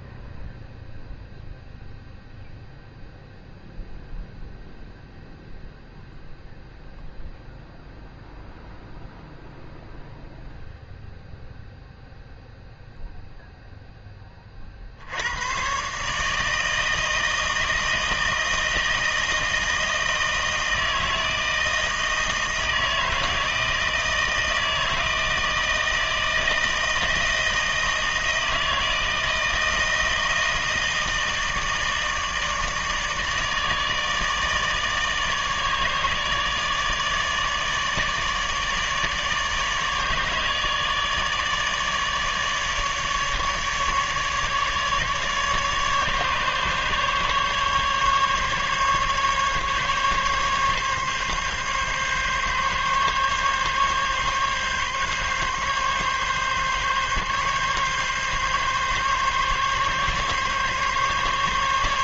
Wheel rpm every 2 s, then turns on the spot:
0, 0, 0, 0, 0, 0, 0, 30, 150, 160, 160, 160, 160, 160, 160, 160, 160, 150, 150, 150, 150, 150, 150, 150, 140, 140, 140, 140, 140, 140, 140.
none